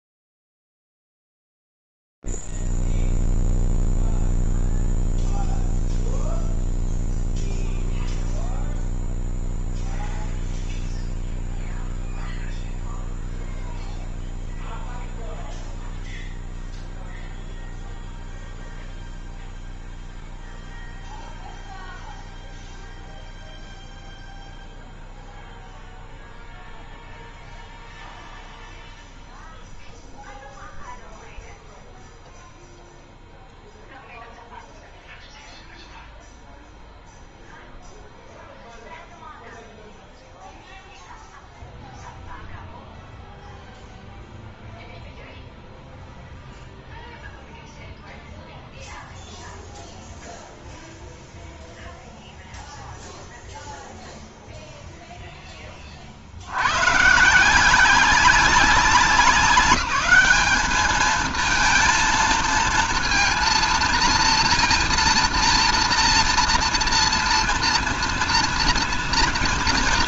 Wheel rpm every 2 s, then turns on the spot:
0, 0, 0, 0, 0, 0, 0, 0, 0, 0, 0, 0, 0, 0, 0, 0, 0, 0, 0, 0, 0, 0, 0, 0, 0, 0, 0, 0, 90, 190, 210, 230, 230, 230, 230.
none